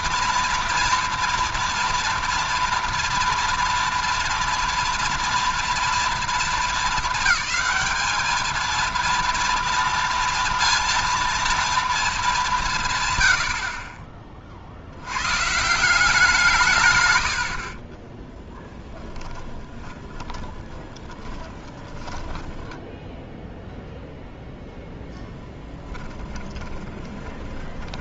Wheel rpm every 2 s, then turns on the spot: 230, 230, 230, 220, 220, 230, 170, 50, 150, 0, 20, 10, 0, 30.
20-24 26-28